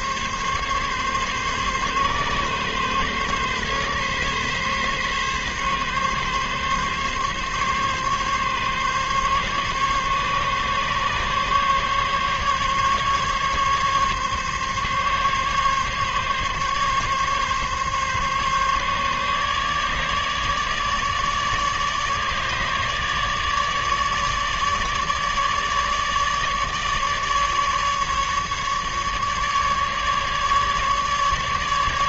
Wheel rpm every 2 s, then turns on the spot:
140, 140, 140, 140, 140, 140, 140, 140, 140, 140, 150, 150, 150, 150, 150, 150.
none